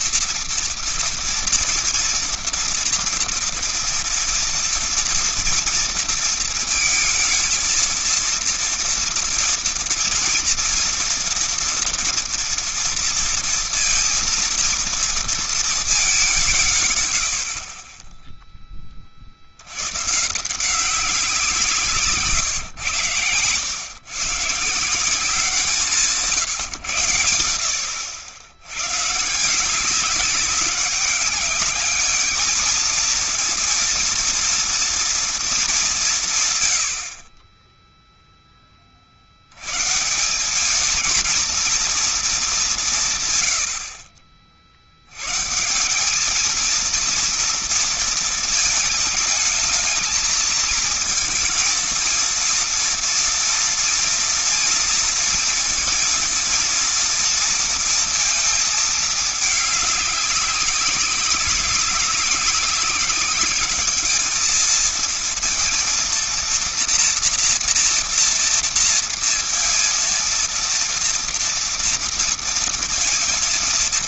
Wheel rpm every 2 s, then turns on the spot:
240, 240, 230, 230, 230, 230, 230, 230, 190, 20, 140, 130, 130, 150, 100, 200, 210, 230, 170, 10, 190, 210, 50, 220, 220, 220, 230, 230, 230, 220, 200, 200, 220, 230, 230, 230, 230.
none